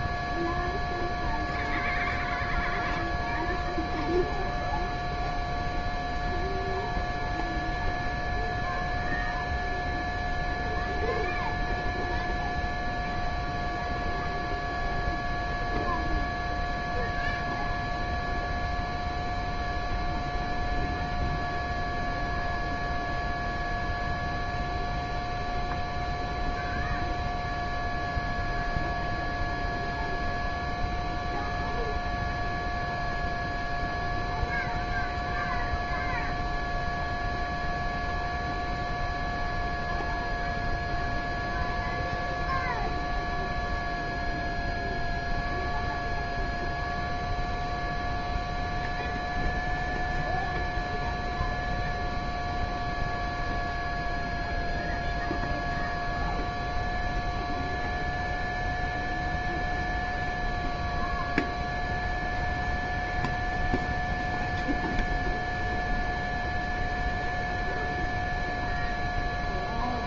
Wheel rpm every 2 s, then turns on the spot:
0, 0, 0, 0, 0, 0, 0, 0, 0, 0, 0, 0, 0, 0, 0, 0, 0, 0, 0, 0, 0, 0, 0, 0, 0, 0, 0, 0, 0, 0, 0, 0, 0, 0, 0.
none